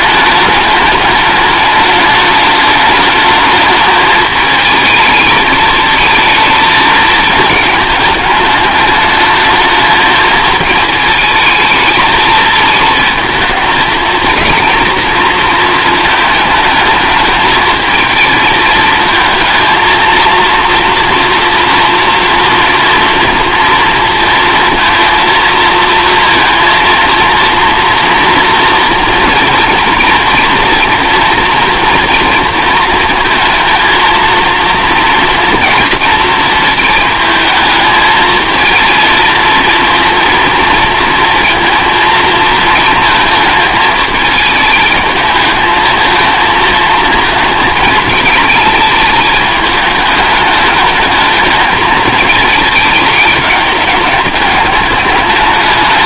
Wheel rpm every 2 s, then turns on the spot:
210, 210, 220, 220, 210, 220, 220, 220, 220, 220, 230, 240, 230, 230, 230, 230, 220, 230, 220, 230, 230, 220, 220, 230, 210, 210, 210, 210.
none